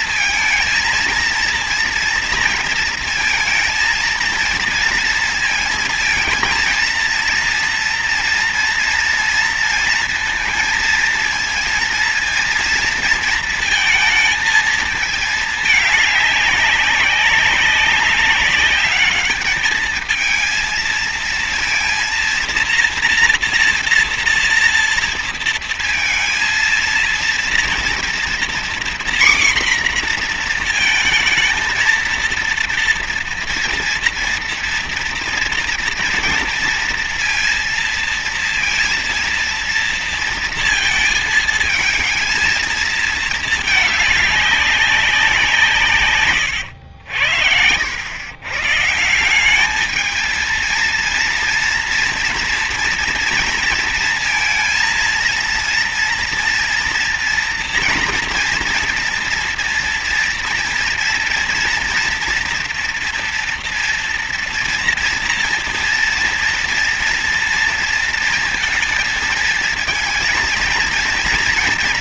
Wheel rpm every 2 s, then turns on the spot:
230, 230, 230, 230, 230, 220, 230, 220, 200, 200, 220, 230, 230, 230, 240, 240, 230, 230, 230, 230, 230, 230, 210, 110, 120, 220, 240, 230, 230, 240, 230, 230, 230, 230, 230, 230.
none